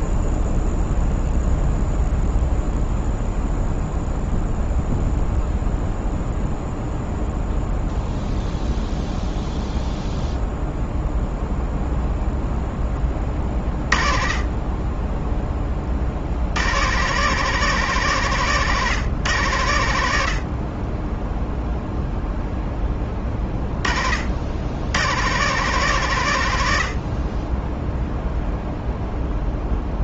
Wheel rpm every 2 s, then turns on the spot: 0, 0, 0, 0, 0, 0, 20, 10, 140, 130, 10, 10, 110, 40, 0.
none